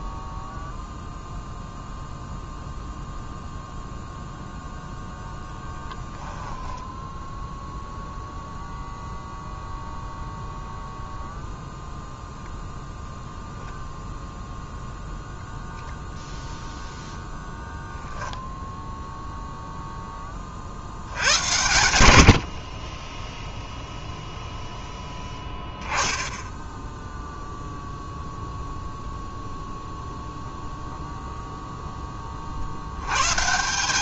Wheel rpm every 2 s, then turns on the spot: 0, 0, 0, 10, 0, 0, 0, 0, 0, 0, 30, 70, 0, 0, 0, 0, 50.
none